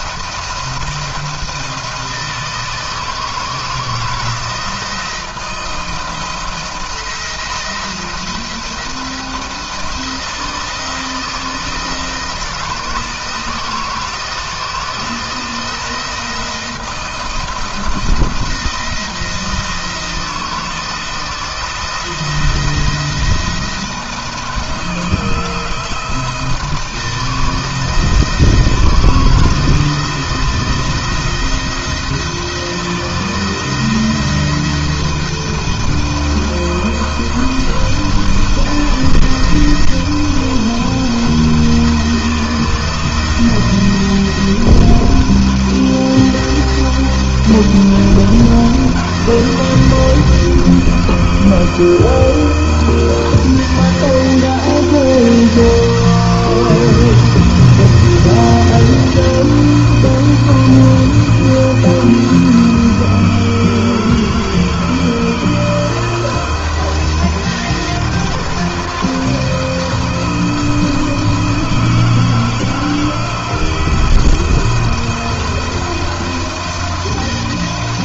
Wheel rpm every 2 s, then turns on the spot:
170, 160, 170, 170, 170, 170, 160, 160, 170, 170, 170, 170, 160, 170, 160, 170, 170, 170, 170, 170, 170, 160, 170, 170, 170, 160, 160, 170, 160, 170, 170, 160, 160, 170, 170, 170, 170, 170, 170.
none